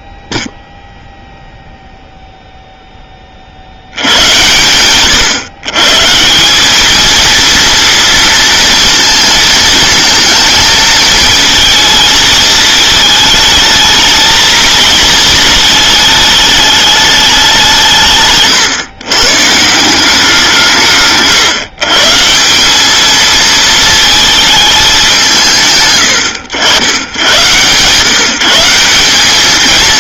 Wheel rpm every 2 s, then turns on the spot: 0, 0, 100, 190, 230, 220, 220, 230, 210, 140, 170, 190, 220, 100, 170.
none